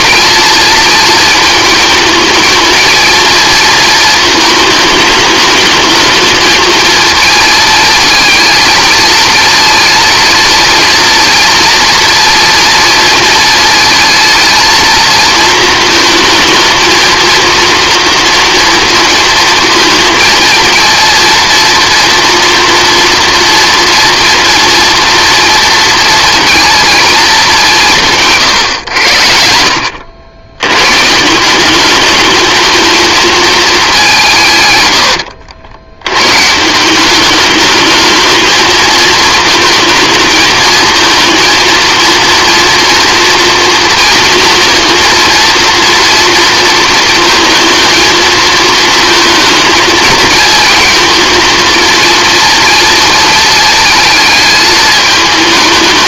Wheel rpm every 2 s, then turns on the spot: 230, 220, 220, 220, 220, 230, 230, 220, 230, 230, 230, 240, 230, 230, 110, 110, 220, 110, 170, 220, 230, 230, 230, 230, 220, 230, 230, 220.
none